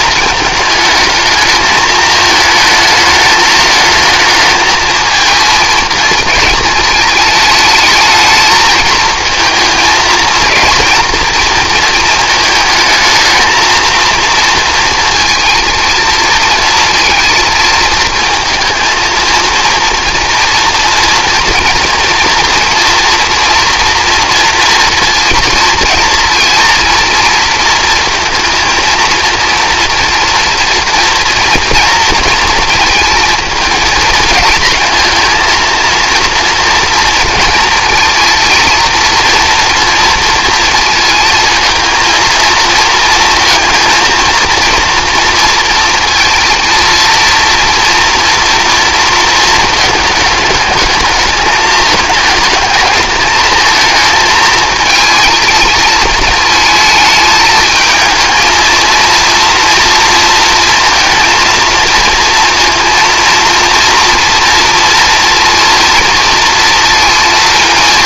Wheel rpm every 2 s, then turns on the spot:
220, 220, 220, 220, 220, 230, 220, 230, 230, 220, 230, 230, 230, 230, 230, 240, 230, 230, 230, 230, 230, 230, 230, 230, 230, 220, 210, 220, 220, 230, 230, 230, 230, 230.
none